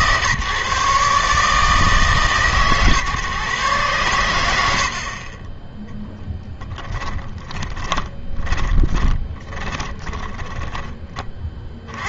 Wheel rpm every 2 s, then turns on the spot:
150, 140, 80, 20, 20, 10.
6-12